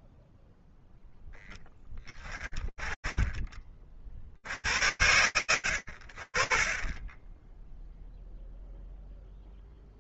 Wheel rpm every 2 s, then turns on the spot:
0, 30, 80, 10, 0.
none